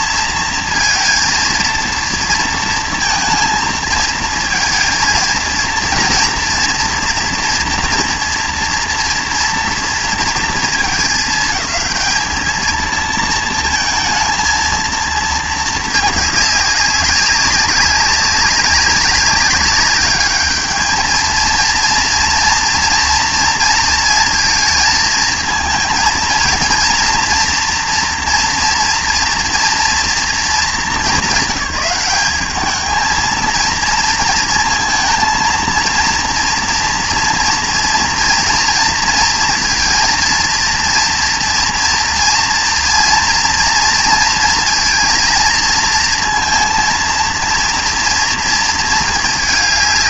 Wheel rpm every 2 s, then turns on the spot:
230, 230, 230, 240, 230, 230, 220, 230, 200, 190, 210, 240, 220, 230, 230, 210, 210, 230, 230, 230, 230, 230, 230, 230, 230.
none